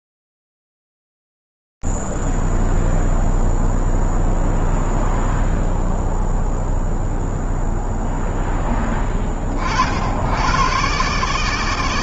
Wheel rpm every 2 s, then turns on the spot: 0, 0, 0, 0, 10, 90.
none